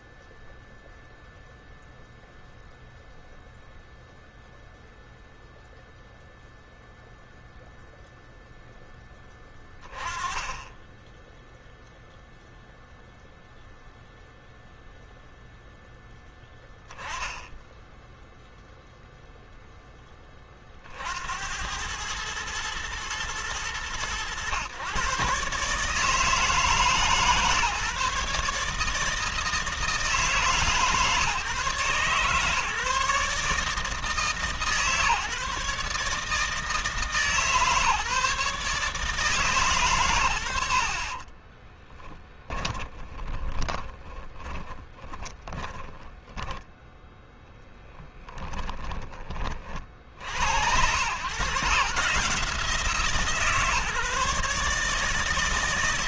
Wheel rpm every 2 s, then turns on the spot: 0, 0, 0, 0, 10, 20, 0, 0, 10, 0, 40, 110, 120, 140, 150, 140, 150, 150, 150, 150, 60, 20, 40, 10, 20, 90, 160, 150.
42-46